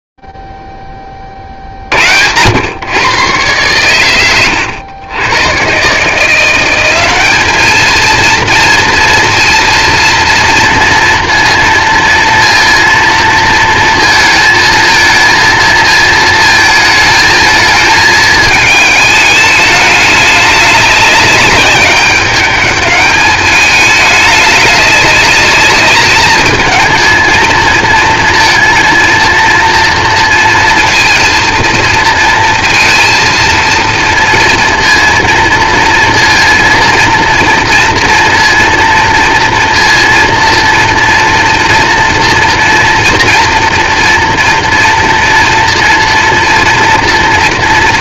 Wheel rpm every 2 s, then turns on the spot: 0, 80, 120, 140, 220, 230, 230, 230, 220, 220, 210, 200, 210, 210, 230, 230, 230, 230, 230, 230, 230, 230, 240, 230.
none